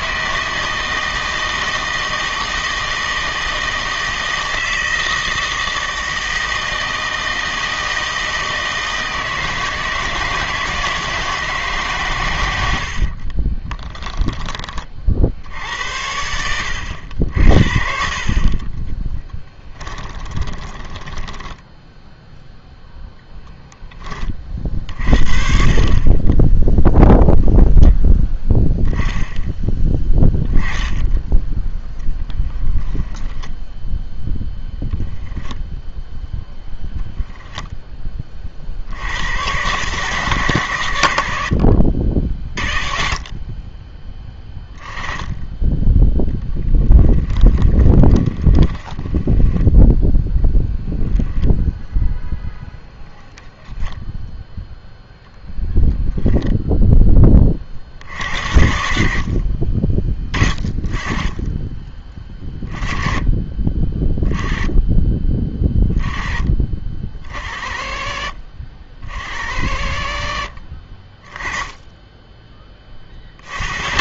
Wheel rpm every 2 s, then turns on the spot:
160, 160, 160, 160, 160, 160, 80, 30, 80, 30, 10, 0, 40, 10, 0, 10, 10, 0, 0, 50, 120, 50, 10, 10, 10, 0, 0, 0, 0, 60, 20, 10, 10, 30, 50, 40, 20.
18-22 48-50 70-72